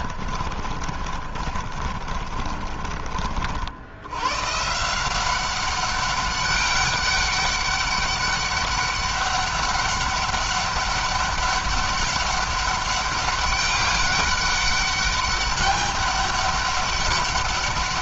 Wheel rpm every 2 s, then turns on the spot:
40, 40, 150, 200, 200, 200, 200, 200, 200.
0-4